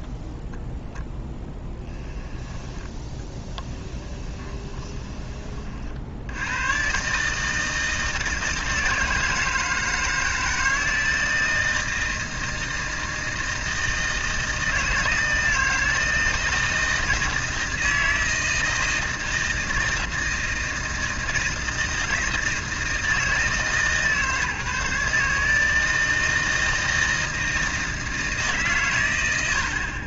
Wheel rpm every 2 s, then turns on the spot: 0, 10, 20, 100, 160, 160, 160, 160, 160, 160, 160, 160, 150, 160, 150.
4-6